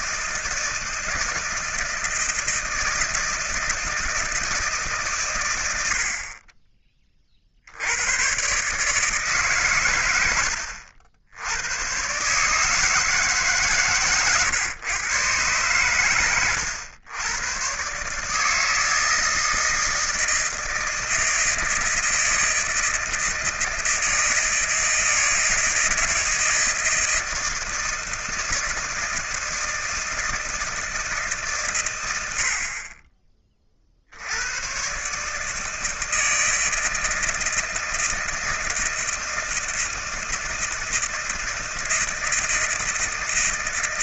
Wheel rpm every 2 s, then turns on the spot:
160, 160, 150, 30, 140, 80, 160, 110, 100, 160, 160, 160, 160, 160, 160, 160, 60, 110, 160, 160, 160, 160.
none